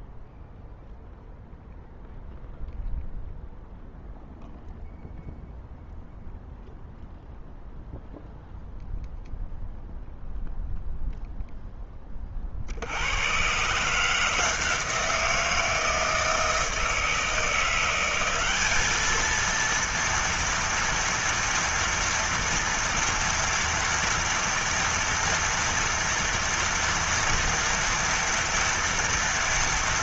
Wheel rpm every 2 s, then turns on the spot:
0, 0, 0, 0, 0, 0, 40, 160, 160, 200, 230, 230, 230, 230, 230.
none